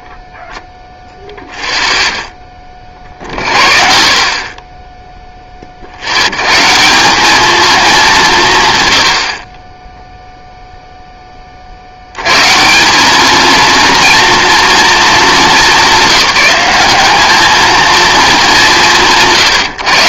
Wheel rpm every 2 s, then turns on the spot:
0, 20, 20, 150, 140, 0, 170, 220, 200, 180.
none